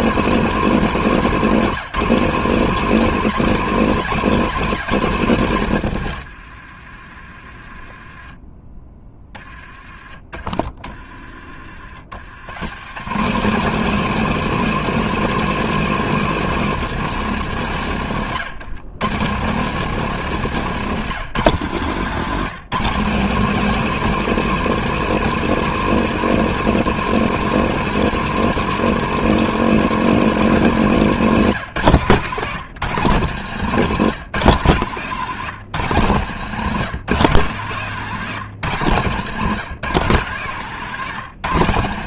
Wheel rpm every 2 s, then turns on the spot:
210, 210, 180, 60, 20, 30, 160, 220, 210, 140, 170, 200, 230, 220, 220, 200, 150, 160, 170, 140, 160.
40-42